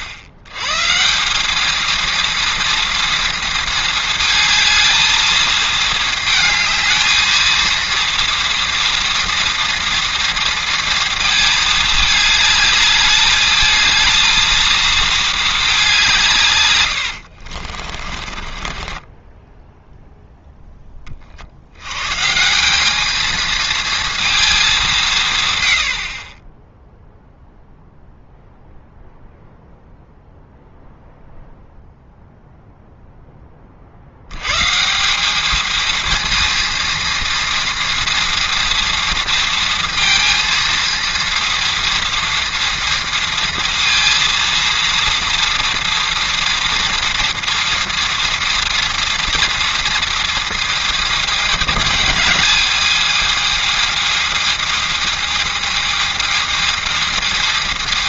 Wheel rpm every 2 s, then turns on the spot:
110, 230, 220, 220, 230, 230, 210, 230, 110, 30, 10, 180, 200, 10, 0, 0, 0, 150, 230, 230, 230, 230, 230, 230, 240, 230, 220, 220, 220.
18-20